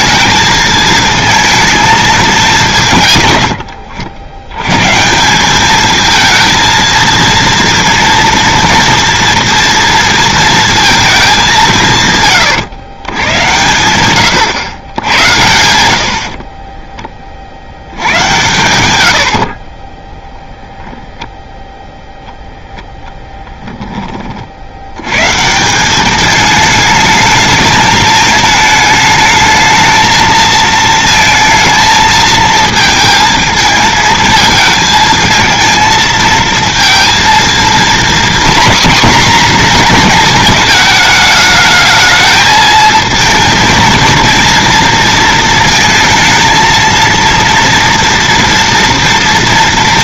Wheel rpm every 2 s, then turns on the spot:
220, 180, 110, 230, 230, 230, 120, 100, 30, 100, 10, 0, 60, 210, 220, 230, 220, 220, 230, 250, 220, 220, 230, 230, 230.
16-20